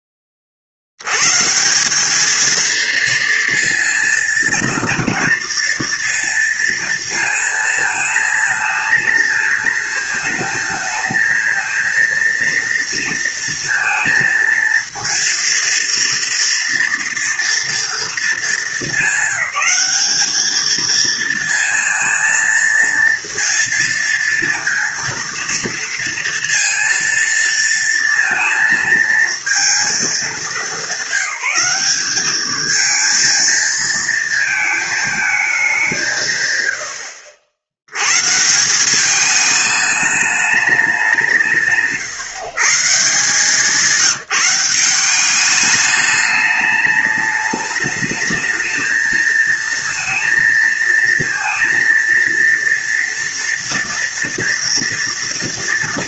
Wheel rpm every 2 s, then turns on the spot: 70, 230, 230, 230, 220, 220, 230, 230, 230, 200, 230, 230, 230, 230, 230, 190, 230, 220, 70, 190, 190, 160, 190, 210, 220, 230, 230, 230.
none